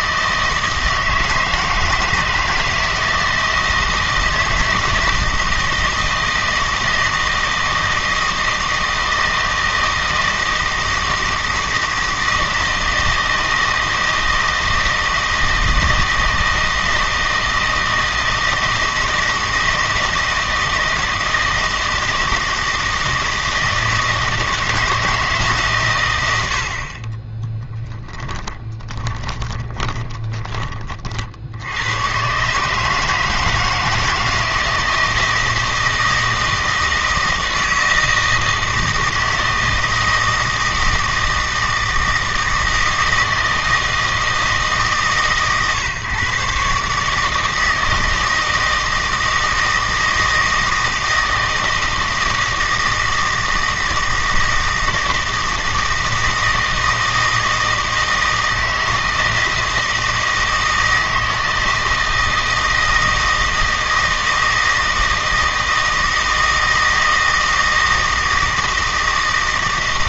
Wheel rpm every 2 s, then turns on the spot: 160, 160, 160, 160, 160, 160, 160, 160, 160, 160, 160, 160, 160, 60, 20, 30, 150, 160, 160, 160, 160, 160, 150, 140, 160, 160, 160, 160, 160, 160, 160, 160, 160, 160, 160.
28-30